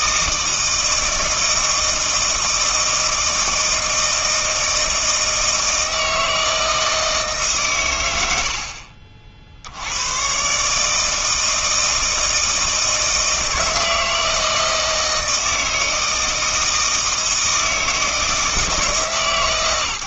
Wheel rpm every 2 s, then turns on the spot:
160, 160, 160, 160, 60, 140, 160, 160, 160, 160.
8-10